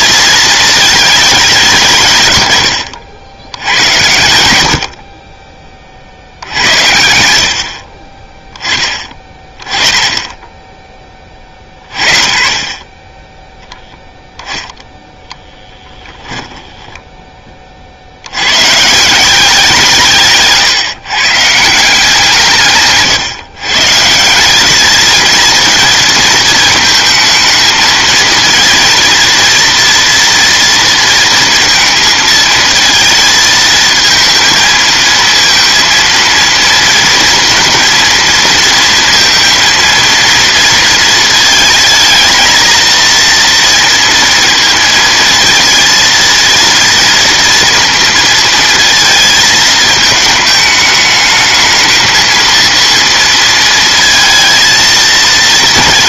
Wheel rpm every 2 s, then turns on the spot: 220, 100, 70, 70, 20, 10, 30, 0, 10, 120, 150, 160, 200, 220, 230, 230, 220, 230, 230, 230, 230, 230, 230, 230, 230, 210, 230, 230.
16-18